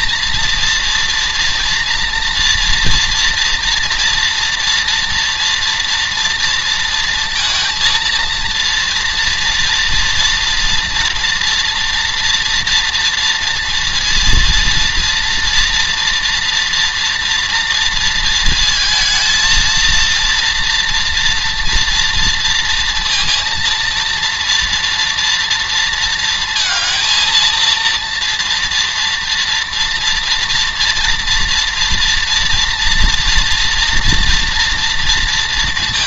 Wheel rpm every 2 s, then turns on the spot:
230, 230, 230, 230, 230, 230, 230, 230, 230, 220, 230, 230, 230, 230, 230, 230, 230, 230.
none